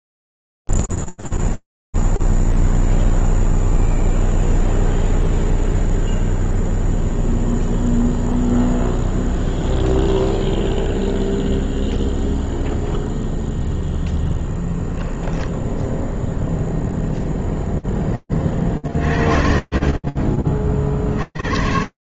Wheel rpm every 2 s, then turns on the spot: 0, 0, 0, 0, 0, 0, 0, 10, 0, 60, 90.
none